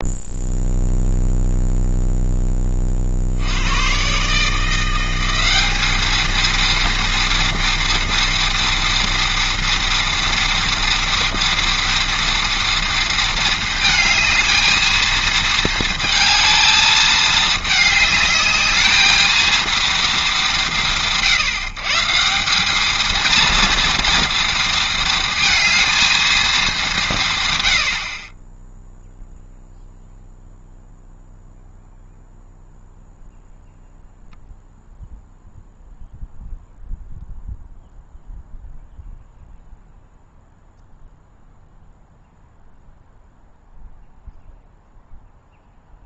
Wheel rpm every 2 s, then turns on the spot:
0, 30, 170, 230, 230, 230, 230, 220, 220, 220, 140, 210, 230, 190, 0, 0, 0, 0, 0, 0, 0, 0, 0.
none